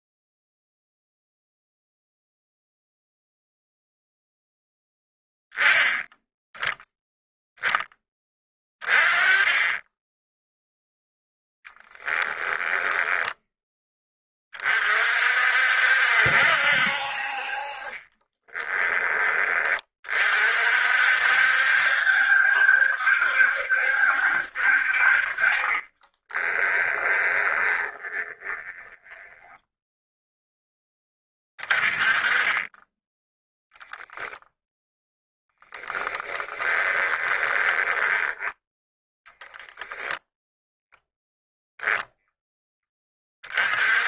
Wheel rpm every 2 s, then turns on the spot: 0, 0, 0, 0, 20, 0, 10, 40, 60, 20, 60, 70, 60, 20, 10, 10, 20, 10, 20, 10, 0, 10.
12-14 26-30 34-38